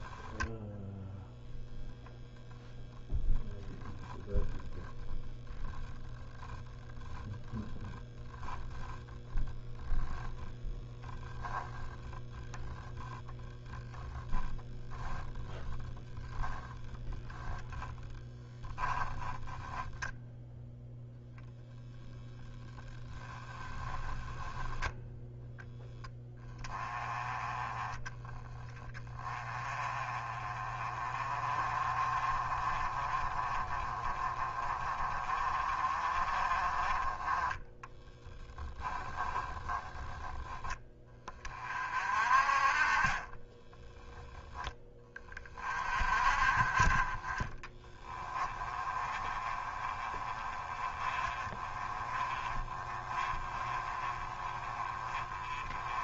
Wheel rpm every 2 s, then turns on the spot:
0, 0, 0, 10, 0, 0, 0, 0, 10, 10, 0, 10, 10, 20, 20, 30, 30, 30, 20, 10, 20, 30, 20, 30, 20, 20, 20, 40.
18-20 22-24 38-40 48-56